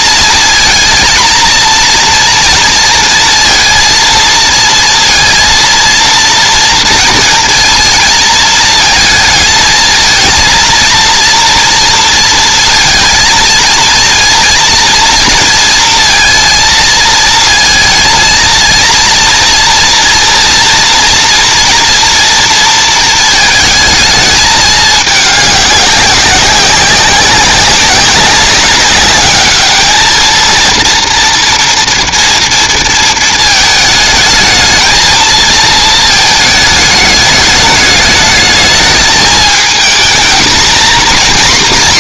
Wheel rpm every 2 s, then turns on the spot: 230, 230, 230, 230, 220, 230, 230, 230, 230, 230, 240, 230, 210, 190, 200, 230, 230, 220, 210, 210, 240.
none